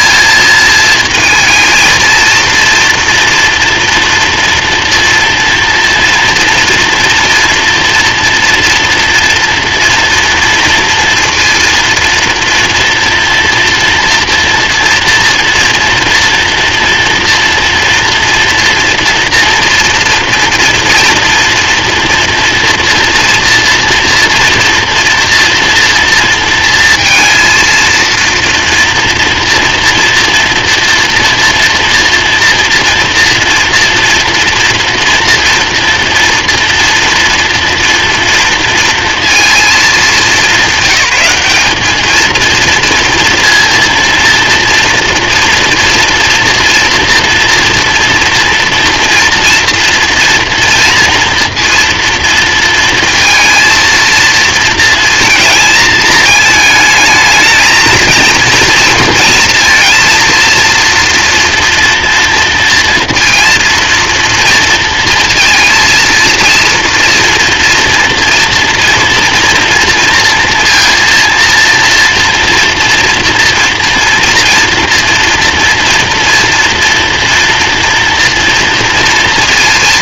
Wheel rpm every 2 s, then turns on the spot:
220, 230, 230, 230, 230, 230, 230, 230, 230, 230, 240, 240, 230, 230, 230, 230, 230, 230, 230, 240, 220, 210, 230, 230, 230, 230, 230, 230, 220, 230, 230, 230, 230, 230, 230, 230, 230, 230, 230, 230.
none